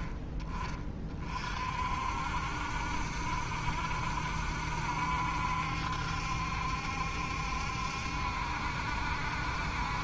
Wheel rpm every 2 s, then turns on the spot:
30, 60, 70, 70, 70.
none